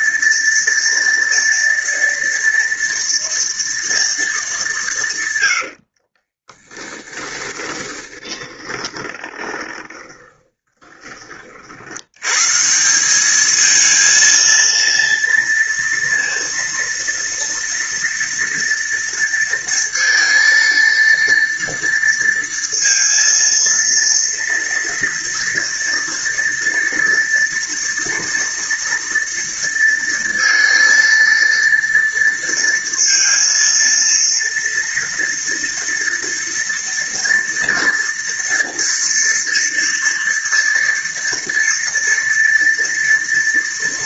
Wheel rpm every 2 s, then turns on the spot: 230, 230, 190, 20, 20, 20, 160, 230, 230, 230, 230, 230, 230, 230, 230, 230, 230, 240, 230, 230, 230, 240.
6-12